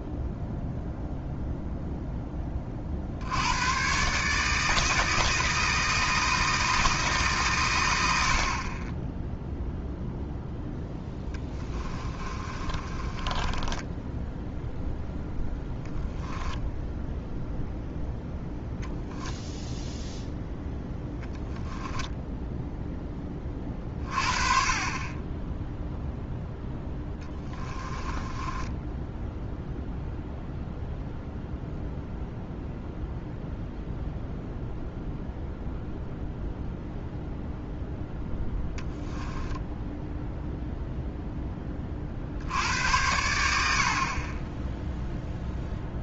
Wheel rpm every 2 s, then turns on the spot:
0, 50, 160, 160, 20, 10, 30, 0, 0, 0, 0, 0, 30, 10, 10, 0, 0, 0, 0, 10, 0, 80, 0.
10-14 26-30